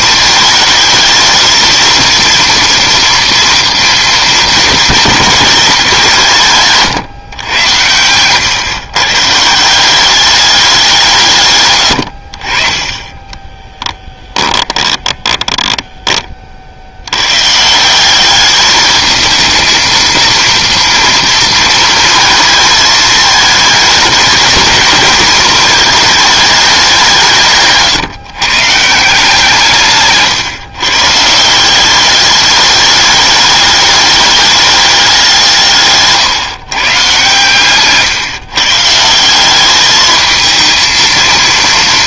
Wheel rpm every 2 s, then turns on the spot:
220, 230, 220, 150, 120, 200, 40, 10, 60, 210, 230, 220, 220, 210, 150, 140, 210, 210, 140, 140, 230.
14-16